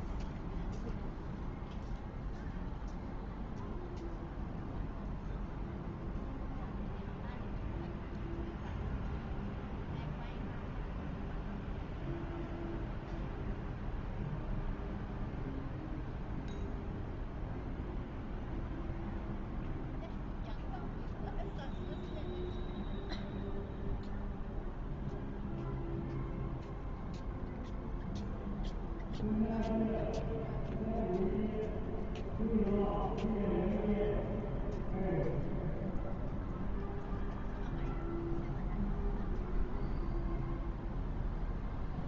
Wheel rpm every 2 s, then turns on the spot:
0, 0, 0, 0, 0, 0, 0, 0, 0, 0, 0, 0, 0, 0, 0, 0, 0, 0, 0, 0, 0.
none